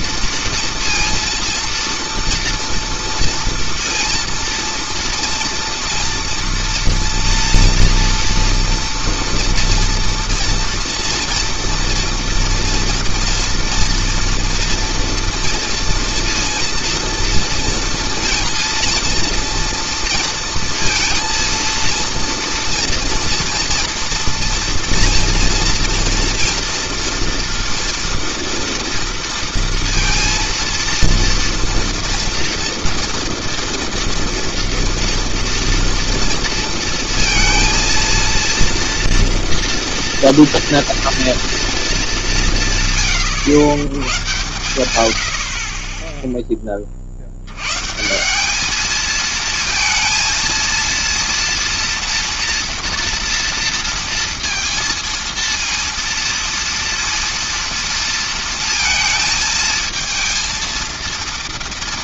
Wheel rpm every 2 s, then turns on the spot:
230, 230, 230, 240, 230, 230, 230, 230, 230, 230, 230, 230, 230, 230, 230, 230, 230, 230, 230, 230, 230, 150, 100, 30, 220, 230, 230, 230, 230, 230, 230.
none